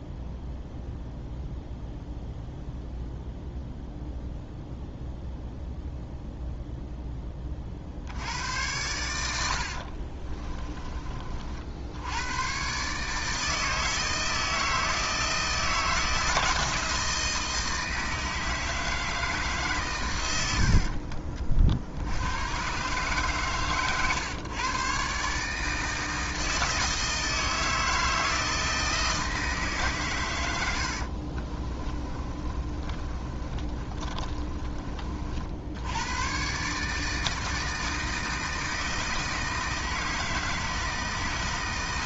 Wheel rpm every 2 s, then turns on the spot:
0, 0, 0, 0, 90, 30, 130, 160, 160, 160, 70, 130, 130, 160, 160, 80, 30, 30, 150, 160, 160.
20-22 30-34